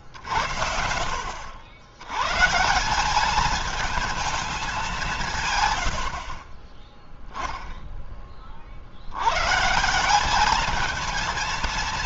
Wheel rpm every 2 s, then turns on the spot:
70, 140, 210, 30, 30, 210.
6-8